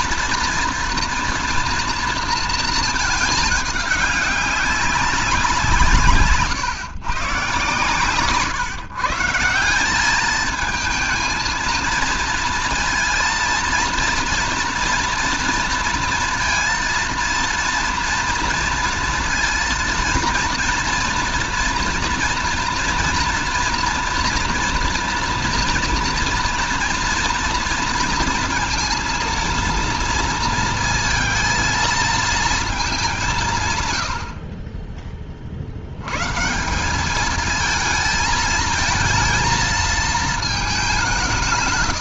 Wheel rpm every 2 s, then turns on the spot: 240, 220, 200, 140, 160, 220, 230, 230, 230, 230, 230, 230, 230, 230, 230, 220, 210, 30, 180, 230, 190.
none